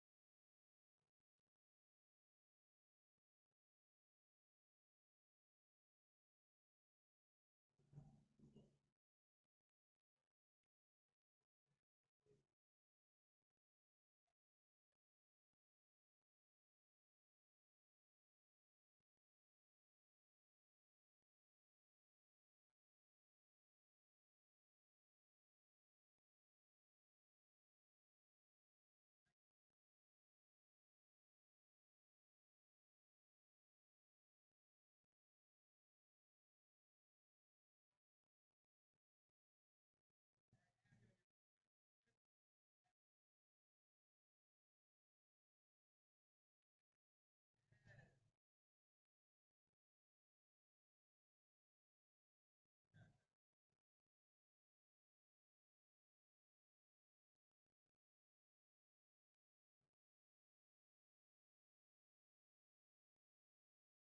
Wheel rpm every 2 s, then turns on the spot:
0, 0, 0, 0, 0, 0, 0, 0, 0, 0, 0, 0, 0, 0, 0, 0, 0, 0, 0, 0, 0, 0, 0, 0, 0, 0, 0, 0, 0, 0, 0, 0.
none